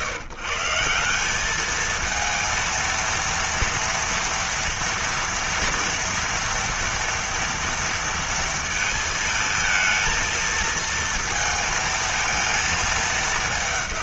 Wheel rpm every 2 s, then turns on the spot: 150, 230, 230, 230, 230, 230, 220.
none